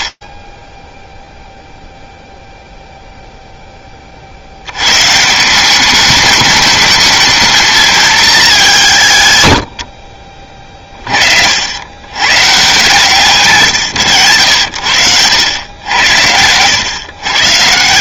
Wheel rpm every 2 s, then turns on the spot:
0, 10, 180, 220, 100, 70, 150, 90, 100.
none